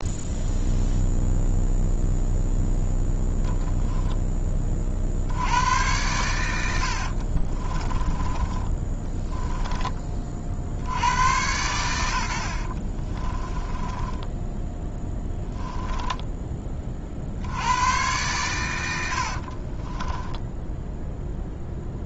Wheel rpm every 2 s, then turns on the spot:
0, 0, 30, 70, 20, 70, 40, 10, 20, 100, 0.
6-10 12-16